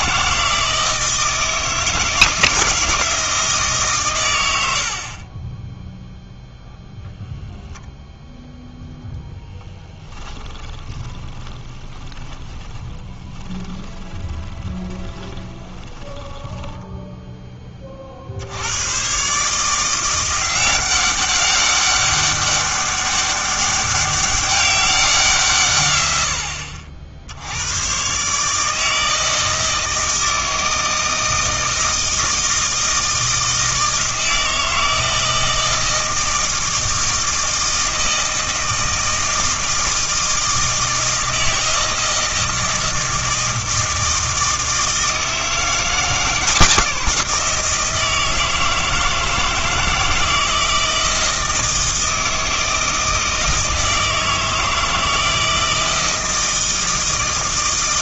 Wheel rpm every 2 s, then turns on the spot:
160, 160, 70, 0, 0, 10, 20, 20, 10, 80, 180, 200, 190, 60, 150, 160, 160, 160, 160, 160, 160, 160, 160, 170, 160, 160, 160, 160, 160.
10-18